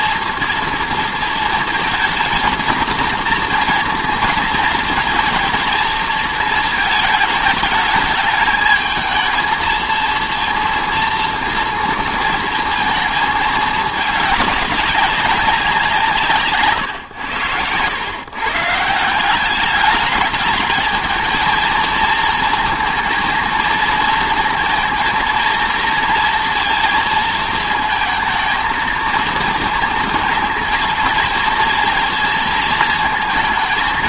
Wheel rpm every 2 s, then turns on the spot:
240, 230, 230, 220, 220, 230, 230, 210, 130, 140, 210, 230, 220, 220, 230, 220, 220.
none